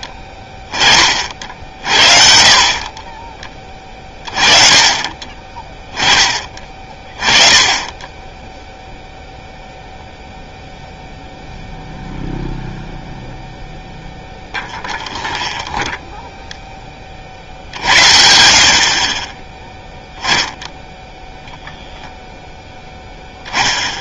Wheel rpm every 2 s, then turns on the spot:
40, 20, 30, 30, 0, 0, 0, 0, 20, 60, 0, 0.
none